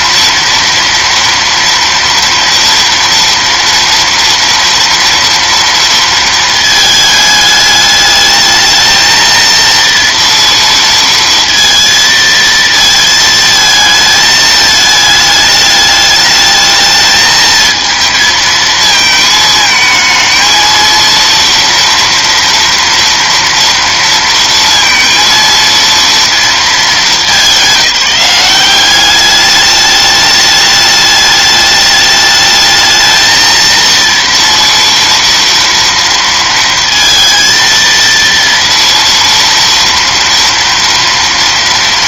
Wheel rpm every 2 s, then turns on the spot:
230, 230, 230, 220, 220, 230, 220, 220, 220, 220, 220, 230, 230, 210, 180, 210, 210, 240, 230, 230, 230.
none